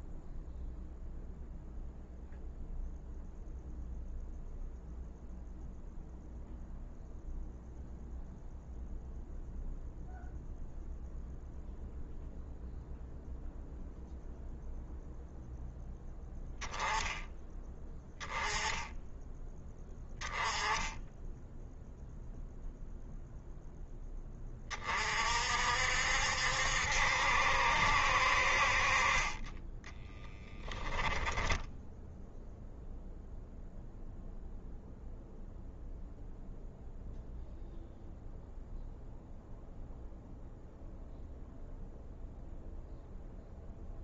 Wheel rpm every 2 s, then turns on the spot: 0, 0, 0, 0, 0, 0, 0, 0, 10, 10, 10, 0, 40, 70, 50, 10, 0, 0, 0, 0, 0, 0.
30-32